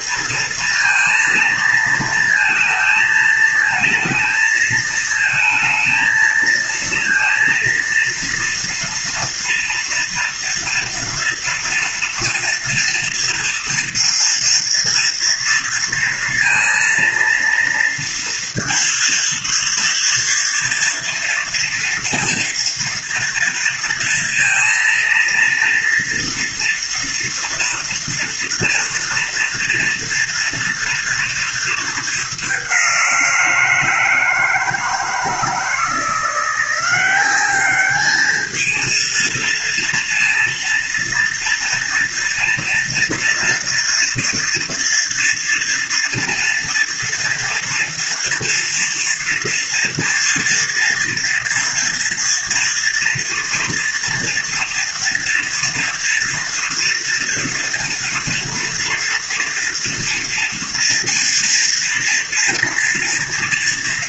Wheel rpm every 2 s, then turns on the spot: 230, 230, 230, 230, 230, 230, 230, 230, 230, 230, 240, 230, 230, 230, 230, 230, 180, 160, 190, 230, 230, 230, 230, 230, 230, 230, 230, 230, 230, 230, 230, 230.
none